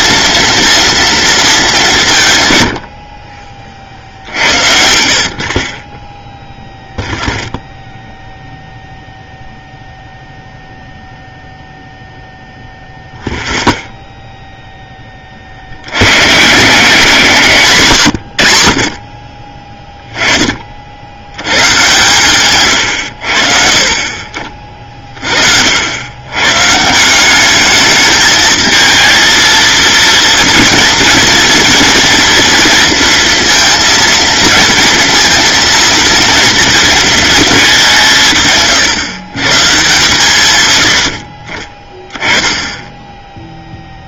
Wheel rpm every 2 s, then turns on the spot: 230, 80, 60, 0, 0, 0, 0, 10, 160, 80, 50, 120, 30, 150, 220, 230, 230, 230, 230, 130, 90, 10.
none